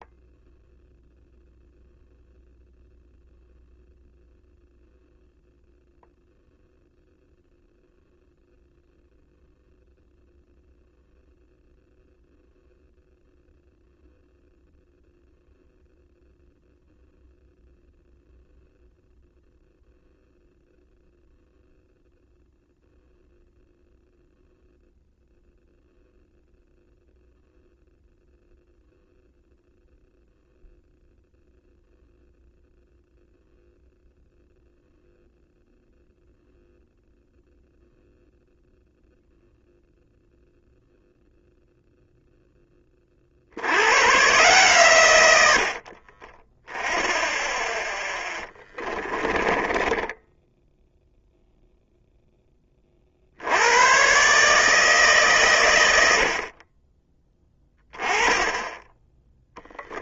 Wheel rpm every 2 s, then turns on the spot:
0, 0, 0, 0, 0, 0, 0, 0, 0, 0, 0, 0, 0, 0, 0, 0, 0, 0, 0, 0, 0, 20, 130, 10, 30, 0, 30, 150, 30, 20.
48-50 56-58